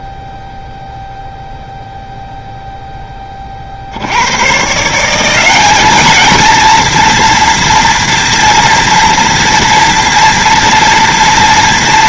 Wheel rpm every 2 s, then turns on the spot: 0, 0, 50, 210, 230, 240.
none